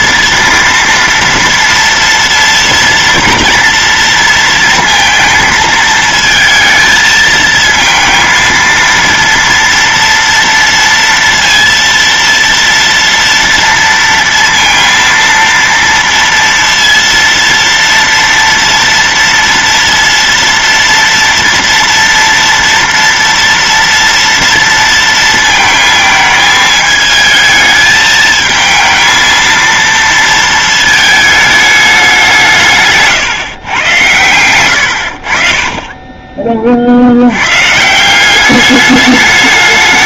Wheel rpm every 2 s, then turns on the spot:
230, 230, 230, 220, 230, 230, 230, 230, 230, 230, 230, 230, 230, 220, 220, 220, 150, 90, 60, 200.
none